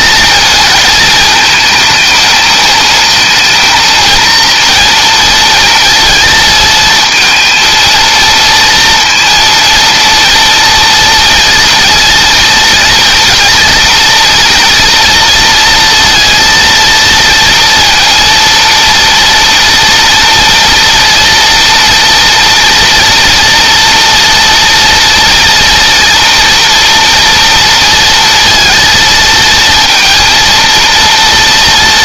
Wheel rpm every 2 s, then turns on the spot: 220, 220, 230, 220, 230, 230, 230, 230, 230, 230, 230, 230, 230, 230, 230, 230.
none